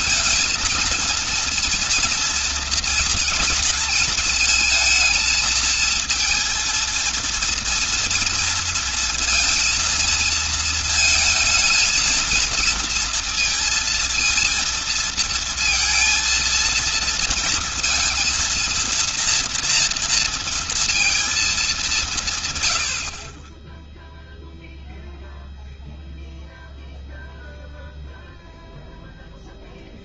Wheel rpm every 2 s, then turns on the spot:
230, 230, 220, 230, 230, 220, 230, 230, 230, 230, 230, 70, 0, 0, 0.
none